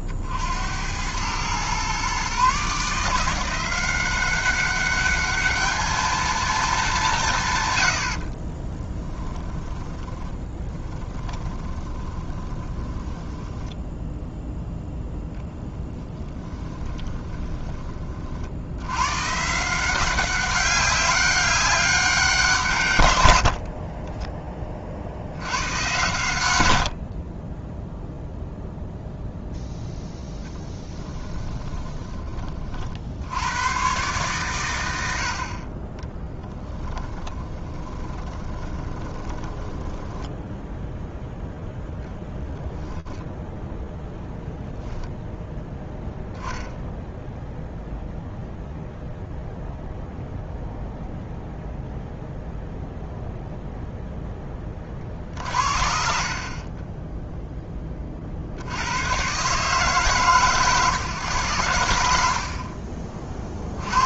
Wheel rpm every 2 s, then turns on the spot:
60, 130, 190, 220, 70, 20, 20, 10, 10, 40, 190, 180, 20, 100, 0, 0, 20, 120, 10, 20, 10, 0, 0, 0, 0, 0, 0, 20, 30, 70, 130, 50.
8-14 16-18 36-42 62-64